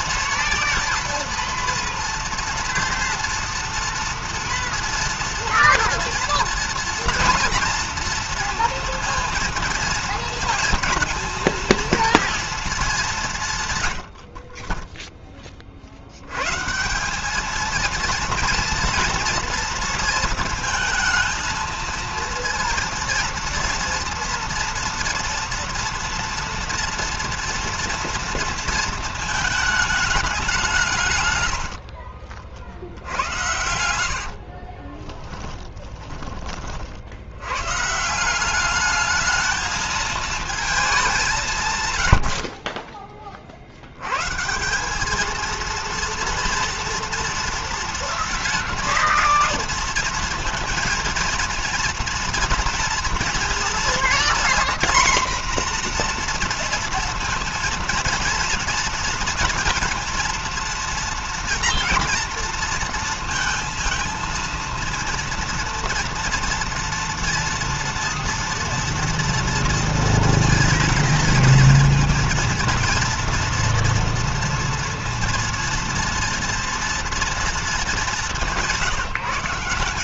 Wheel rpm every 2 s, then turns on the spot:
230, 230, 230, 230, 230, 230, 220, 40, 120, 230, 230, 230, 230, 230, 230, 190, 50, 50, 30, 180, 220, 60, 150, 230, 230, 230, 230, 240, 240, 230, 230, 230, 230, 230, 230, 230, 230, 230, 230, 190.
34-36